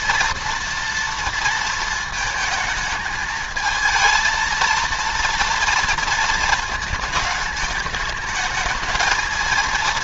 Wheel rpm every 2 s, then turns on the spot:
230, 220, 230, 220, 220.
none